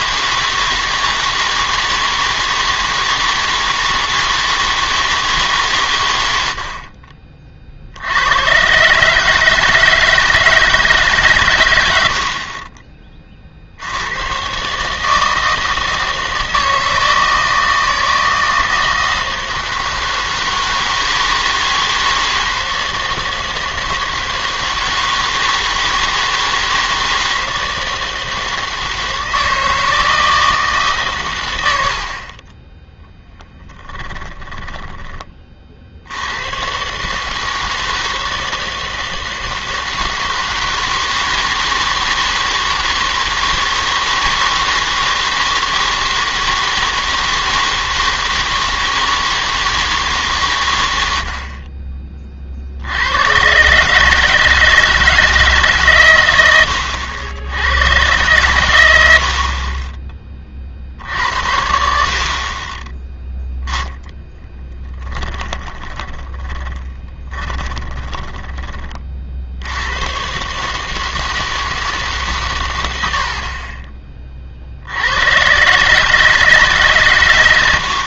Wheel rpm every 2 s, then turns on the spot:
160, 160, 160, 80, 120, 160, 30, 130, 160, 160, 160, 160, 160, 160, 160, 160, 20, 10, 110, 160, 160, 160, 160, 160, 160, 120, 50, 160, 90, 100, 50, 20, 10, 20, 20, 140, 110, 50, 150.
32-36 64-70